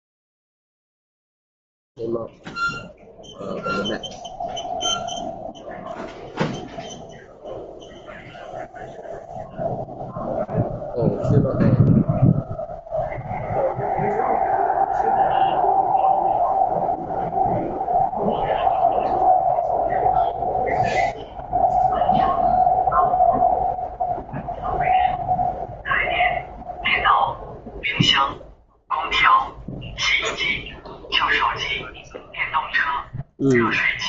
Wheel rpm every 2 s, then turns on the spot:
0, 0, 0, 0, 0, 0, 0, 0, 0, 0, 0, 0, 0, 0, 0, 0, 0.
none